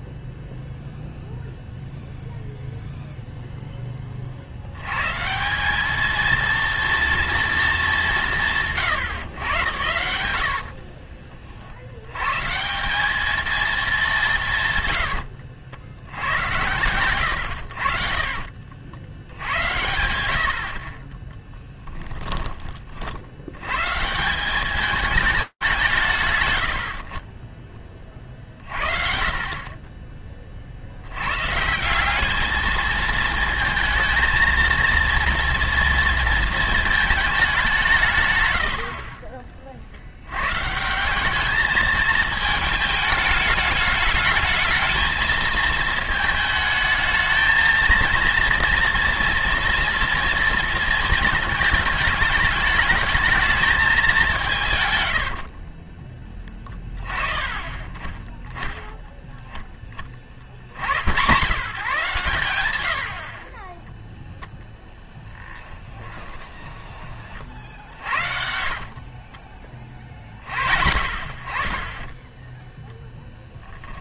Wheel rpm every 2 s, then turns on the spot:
0, 0, 80, 230, 150, 60, 170, 130, 100, 60, 60, 30, 200, 80, 40, 40, 220, 230, 230, 90, 160, 220, 220, 220, 230, 230, 210, 120, 40, 10, 90, 80, 0, 20, 60, 60, 10.
10-12 38-40 54-56 66-70